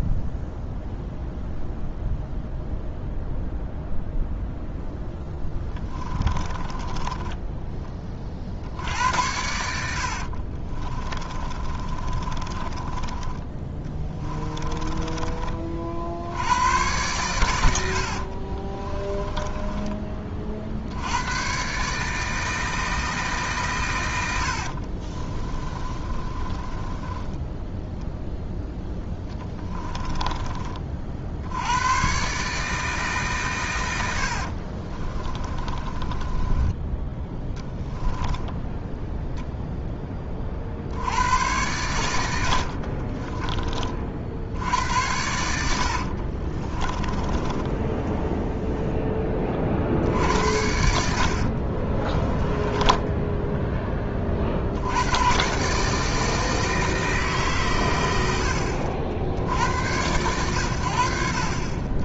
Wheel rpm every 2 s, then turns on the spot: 0, 0, 0, 20, 60, 30, 20, 20, 110, 20, 70, 160, 50, 20, 10, 40, 150, 40, 10, 10, 70, 50, 80, 40, 0, 80, 10, 80, 160, 60, 80.
6-8 10-16 18-20 24-30 34-38 42-44 46-48 50-54